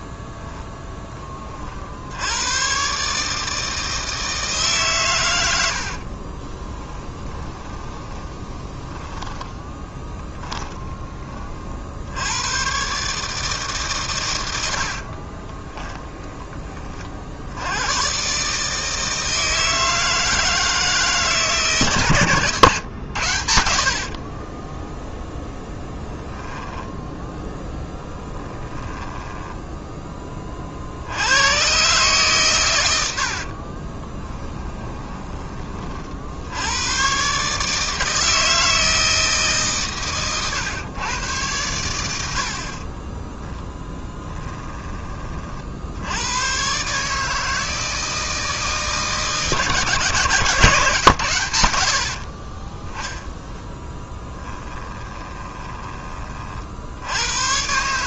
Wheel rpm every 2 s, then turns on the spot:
10, 130, 130, 10, 10, 20, 130, 60, 40, 160, 160, 120, 0, 0, 20, 70, 90, 20, 110, 160, 120, 30, 20, 140, 160, 130, 10, 20, 70.
6-10 14-16 28-30 34-36 54-56